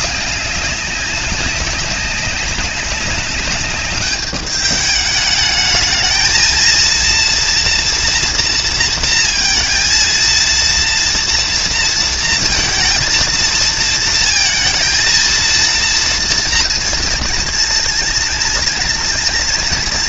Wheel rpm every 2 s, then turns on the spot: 190, 190, 210, 230, 230, 230, 230, 230, 230, 230.
none